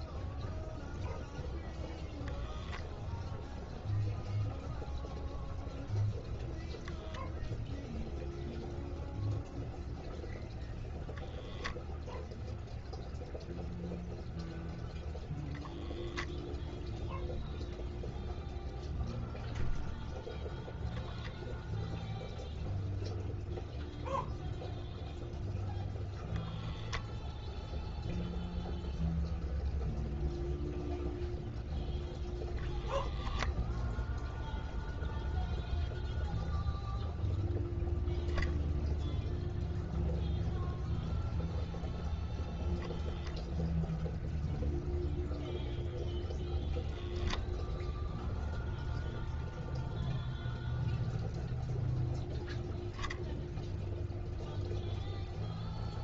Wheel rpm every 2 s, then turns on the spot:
0, 0, 0, 0, 0, 0, 0, 0, 0, 0, 0, 0, 0, 0, 0, 0, 20, 0, 0, 0, 0, 0, 0, 10, 0, 0, 0, 0.
none